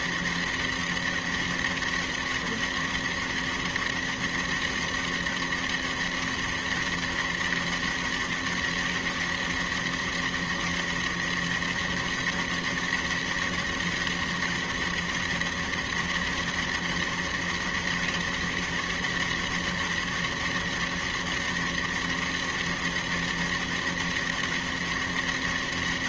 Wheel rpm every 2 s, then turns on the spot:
200, 200, 200, 200, 200, 200, 200, 200, 200, 200, 200, 200, 200.
none